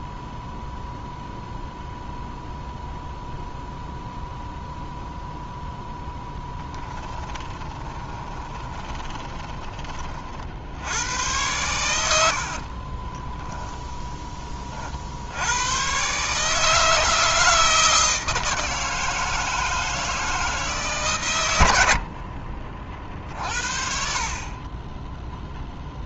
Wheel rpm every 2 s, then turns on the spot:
0, 0, 0, 10, 20, 90, 30, 40, 160, 160, 140, 40, 20.
6-10 12-14